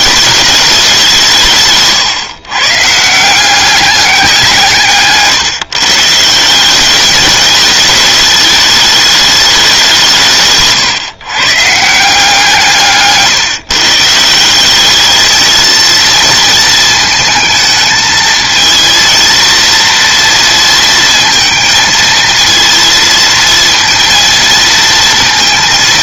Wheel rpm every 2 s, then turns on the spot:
210, 140, 190, 150, 210, 170, 160, 160, 230, 220, 230, 230, 230.
none